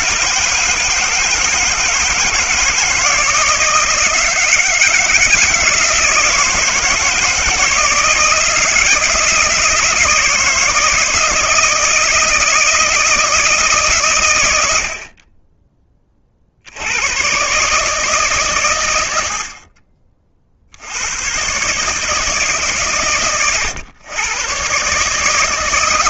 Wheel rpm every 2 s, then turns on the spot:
160, 160, 160, 160, 160, 160, 160, 80, 60, 120, 50, 140, 130.
none